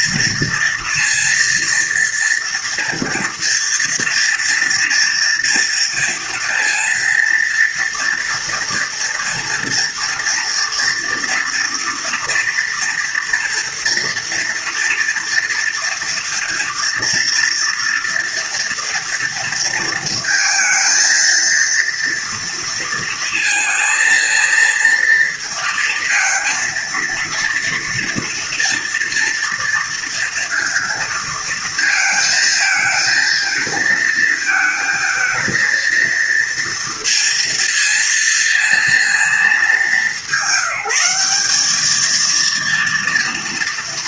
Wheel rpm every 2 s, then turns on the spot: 240, 230, 230, 230, 230, 230, 230, 230, 230, 230, 230, 230, 230, 230, 230, 230, 220, 220, 230, 230, 190, 230.
none